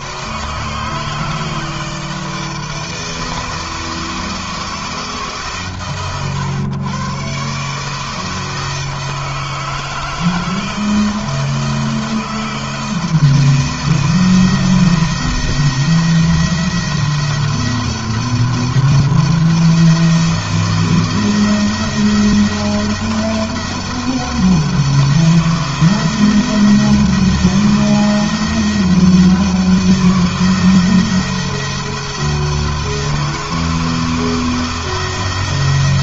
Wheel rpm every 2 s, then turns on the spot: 160, 160, 150, 130, 160, 160, 160, 170, 170, 170, 170, 170, 160, 170, 160, 160, 160, 170.
none